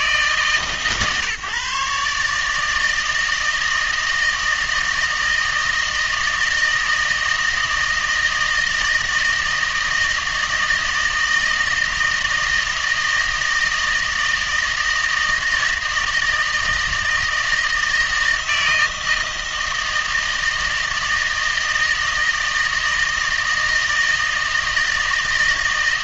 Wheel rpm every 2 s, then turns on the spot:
140, 160, 160, 160, 160, 160, 160, 160, 160, 160, 160, 160, 160.
none